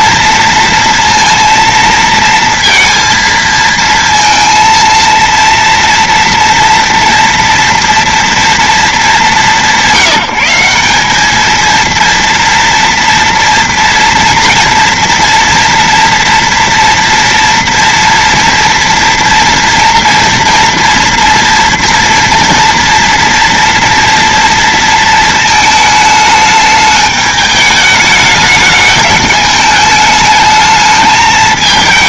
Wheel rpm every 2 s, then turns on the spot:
230, 230, 230, 230, 230, 180, 230, 240, 230, 240, 230, 230, 230, 220, 210, 210.
none